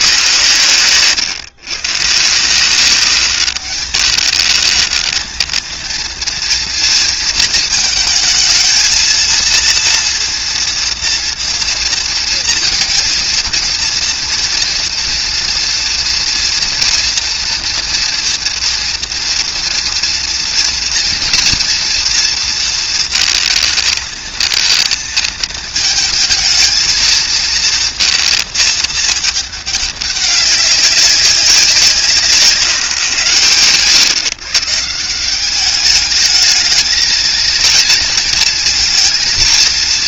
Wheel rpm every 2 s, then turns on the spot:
120, 180, 220, 230, 220, 230, 220, 230, 240, 230, 230, 230, 220, 220, 220, 190, 130, 150, 220, 230.
none